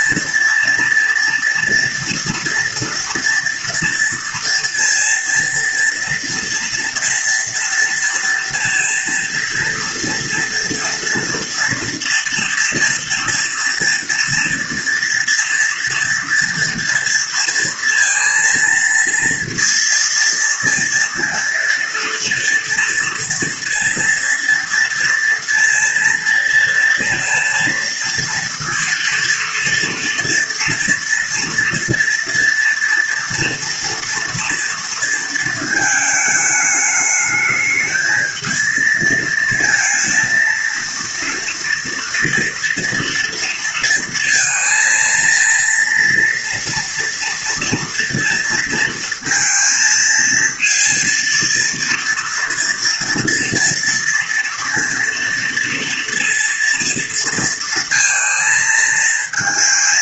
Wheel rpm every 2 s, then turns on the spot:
240, 230, 230, 240, 230, 230, 230, 230, 230, 230, 230, 230, 230, 230, 230, 230, 230, 230, 210, 230, 230, 230, 230, 230, 230, 230, 230, 230, 230, 220.
none